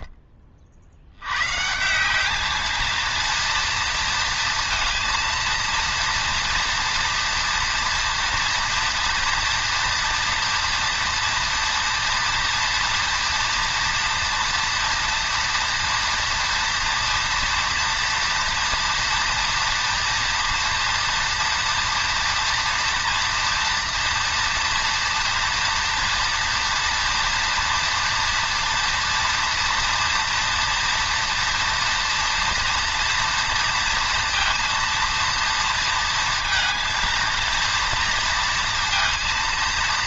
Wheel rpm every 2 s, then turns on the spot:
40, 220, 220, 230, 230, 230, 240, 240, 240, 240, 230, 230, 230, 230, 230, 240, 230, 230, 230, 230.
none